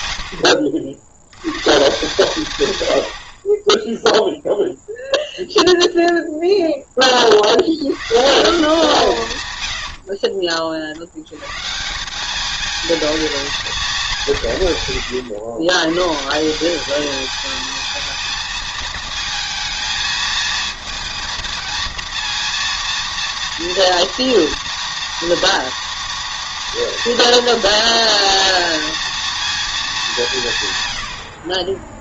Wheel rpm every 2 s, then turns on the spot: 50, 110, 0, 10, 160, 40, 220, 130, 200, 220, 220, 230, 230, 230, 230, 120.
none